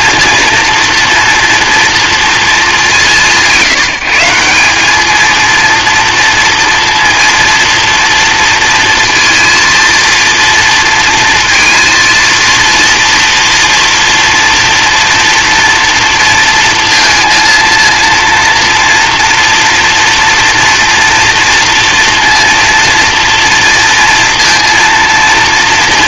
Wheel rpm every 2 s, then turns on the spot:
240, 210, 200, 230, 230, 230, 230, 240, 230, 240, 230, 230, 230.
none